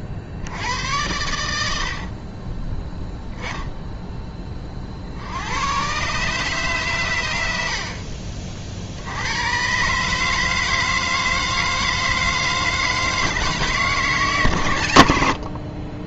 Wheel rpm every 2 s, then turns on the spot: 100, 10, 40, 130, 60, 160, 160, 100.
none